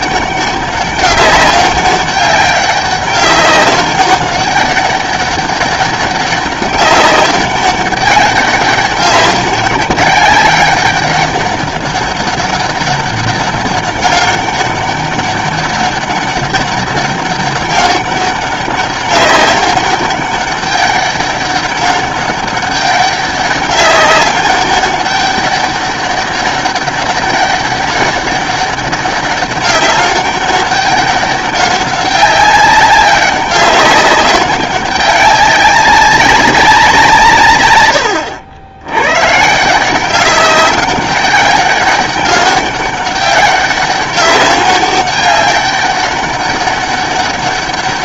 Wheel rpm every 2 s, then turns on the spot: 200, 200, 200, 200, 190, 200, 200, 200, 200, 190, 200, 200, 200, 200, 200, 200, 190, 200, 190, 90, 200, 200, 200, 200.
none